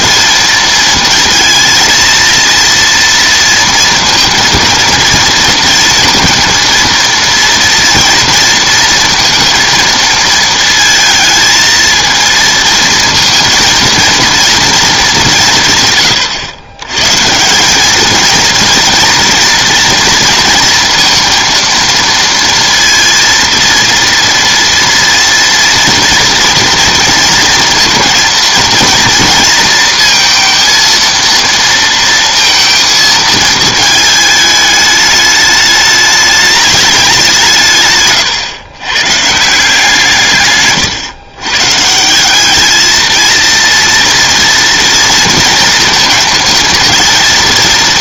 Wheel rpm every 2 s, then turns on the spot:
230, 230, 230, 230, 230, 220, 220, 170, 150, 230, 230, 230, 230, 230, 230, 230, 220, 210, 180, 150, 120, 230, 230, 230.
none